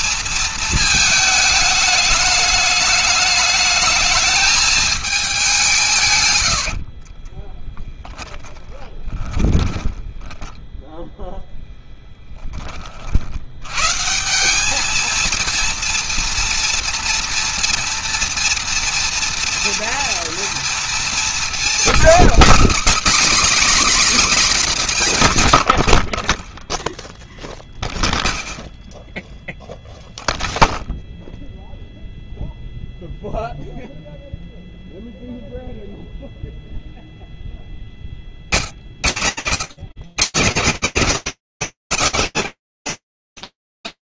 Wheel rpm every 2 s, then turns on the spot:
220, 210, 220, 80, 10, 10, 30, 200, 230, 230, 240, 280, 210, 10, 0, 0, 0, 0, 0, 60, 210, 220.
6-12